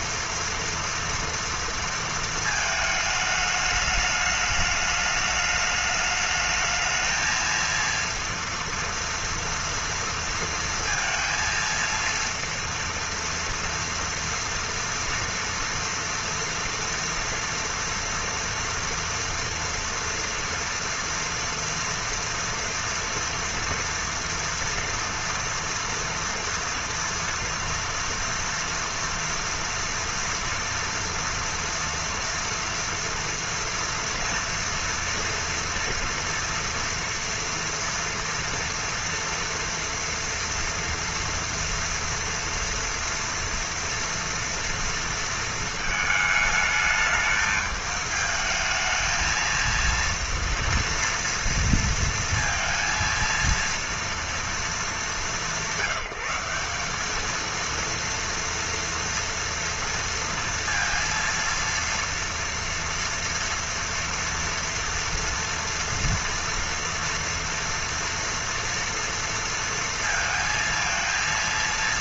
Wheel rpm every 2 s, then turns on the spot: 230, 220, 210, 220, 230, 230, 230, 230, 230, 230, 230, 230, 230, 230, 230, 230, 230, 230, 230, 230, 230, 230, 230, 220, 220, 230, 230, 200, 190, 230, 230, 230, 230, 230, 230, 230.
none